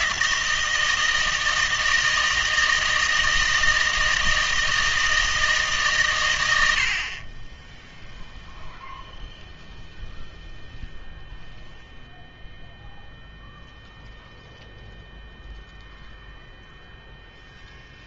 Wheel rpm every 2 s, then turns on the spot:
160, 160, 160, 60, 0, 0, 0, 0, 0.
none